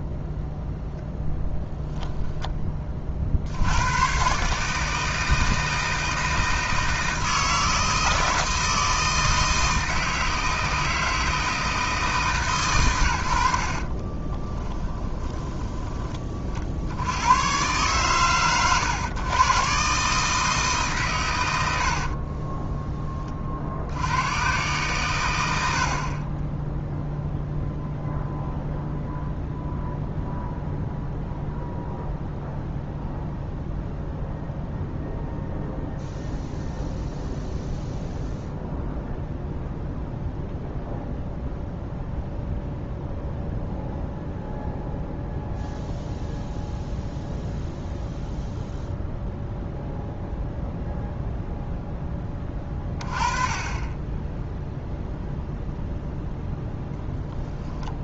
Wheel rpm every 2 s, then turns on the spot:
0, 20, 150, 160, 160, 160, 130, 30, 60, 110, 140, 20, 120, 10, 0, 0, 0, 0, 0, 0, 0, 0, 0, 0, 0, 0, 20, 0, 0.
14-16